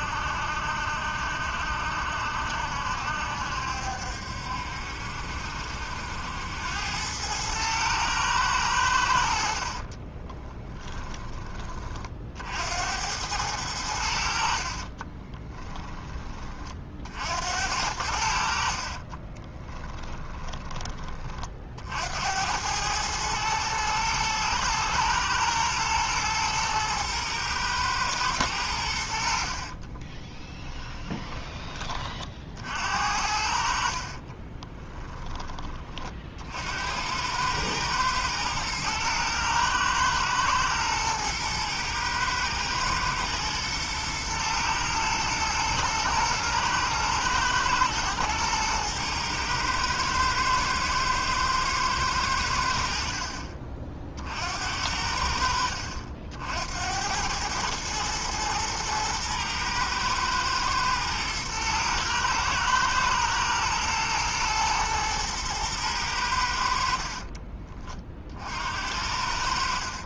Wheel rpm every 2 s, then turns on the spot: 70, 70, 70, 90, 90, 10, 80, 40, 40, 40, 20, 100, 110, 110, 90, 20, 60, 10, 80, 110, 110, 110, 120, 120, 110, 110, 60, 70, 80, 110, 120, 110, 120, 60, 70.
14-16 18-20 30-32 34-36 66-68